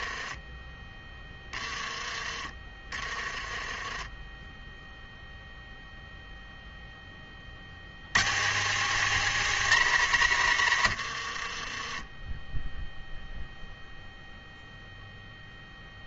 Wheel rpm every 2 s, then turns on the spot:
20, 40, 10, 0, 190, 130, 10, 0.
2-6